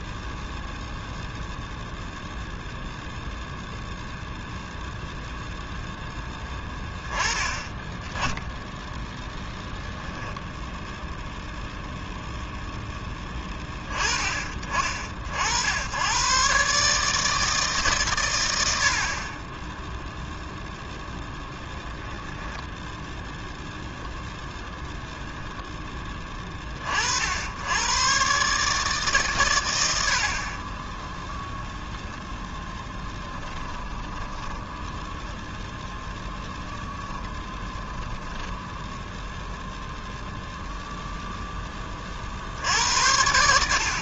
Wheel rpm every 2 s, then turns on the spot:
0, 0, 0, 10, 0, 0, 20, 70, 150, 10, 0, 0, 10, 90, 120, 0, 20, 0, 10, 0, 0, 80.
32-34 36-38